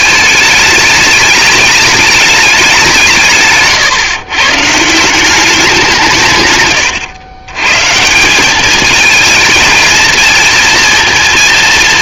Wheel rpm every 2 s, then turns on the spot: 210, 180, 150, 120, 210, 230.
none